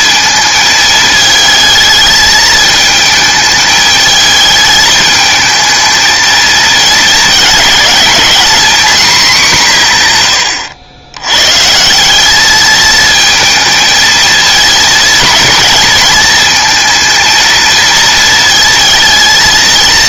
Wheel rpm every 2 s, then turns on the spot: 220, 220, 220, 220, 230, 90, 210, 220, 230, 220.
none